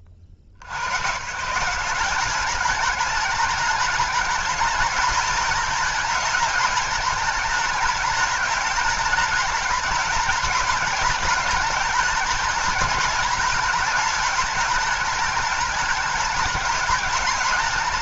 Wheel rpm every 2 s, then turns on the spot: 60, 210, 210, 210, 210, 220, 210, 200, 210.
none